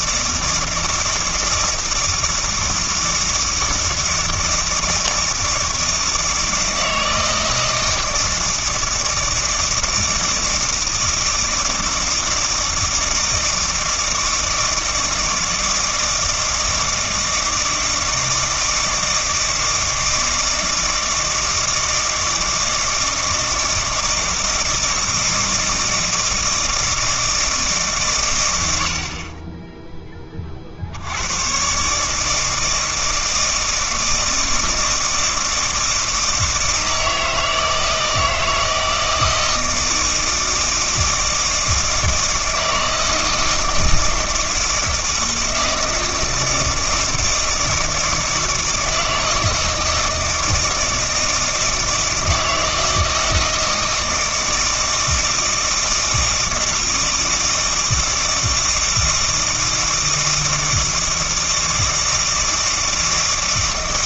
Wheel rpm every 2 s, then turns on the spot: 160, 160, 160, 160, 160, 160, 160, 160, 160, 160, 160, 160, 160, 160, 80, 50, 160, 160, 160, 160, 160, 160, 160, 160, 160, 160, 160, 160, 160, 160, 160, 160.
none